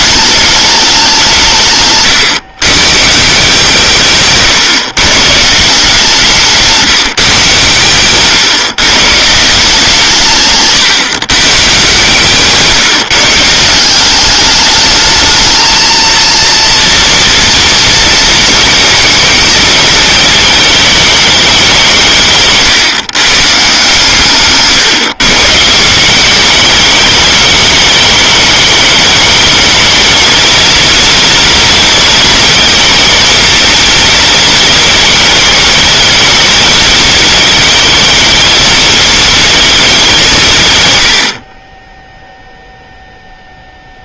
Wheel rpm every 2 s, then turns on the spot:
210, 120, 140, 170, 130, 140, 150, 200, 230, 230, 210, 150, 150, 190, 200, 220, 230, 230, 220, 220, 210, 0.
6-8